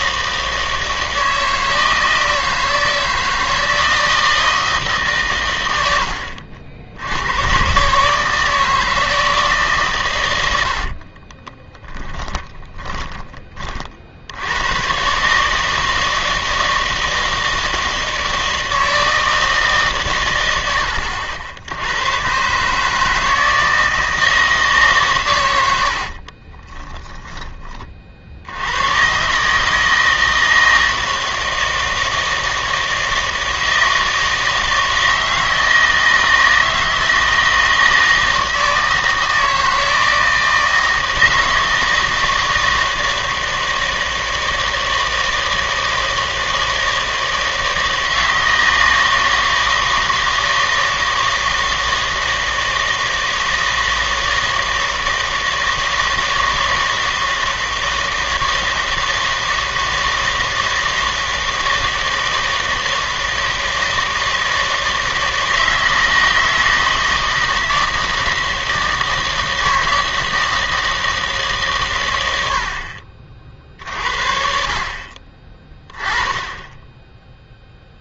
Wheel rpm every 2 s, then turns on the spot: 160, 160, 160, 70, 160, 70, 20, 110, 160, 160, 90, 140, 150, 20, 90, 160, 160, 160, 160, 160, 160, 160, 160, 160, 160, 160, 160, 160, 160, 160, 160, 160, 160, 160, 160, 160, 60, 50, 40.
12-14 26-28